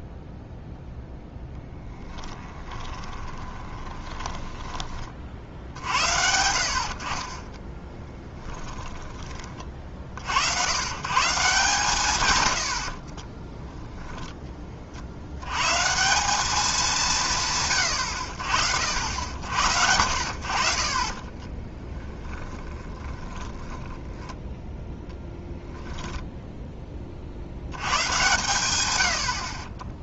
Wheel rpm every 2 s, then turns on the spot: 0, 20, 20, 70, 20, 100, 80, 30, 200, 70, 40, 10, 0, 10, 100.
2-4 8-10 22-24